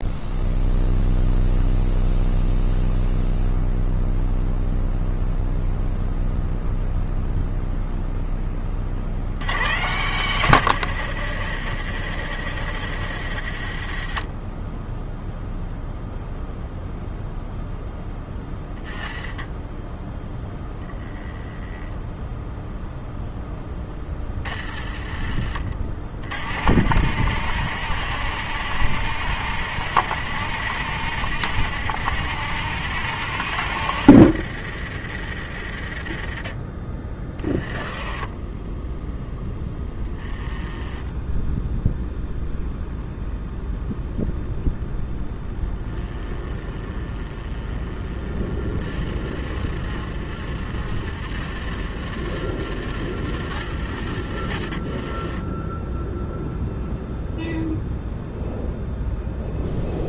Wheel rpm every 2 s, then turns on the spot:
0, 0, 0, 0, 40, 160, 120, 20, 0, 10, 0, 0, 30, 70, 100, 100, 100, 70, 30, 10, 20, 20, 40, 10, 20, 30, 50, 30, 0, 0.
26-36 38-40